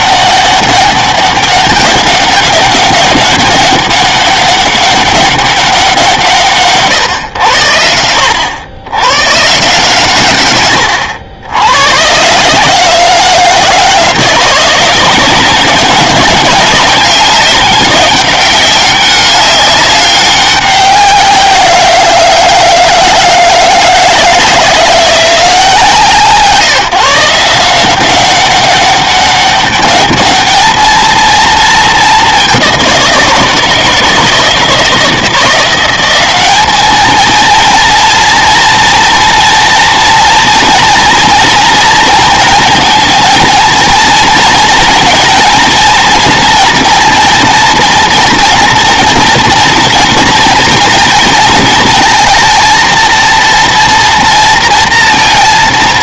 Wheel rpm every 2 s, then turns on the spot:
200, 200, 200, 140, 100, 110, 150, 170, 200, 200, 190, 160, 170, 160, 190, 220, 190, 160, 200, 240, 230, 230, 230, 230, 230, 240, 230, 230.
none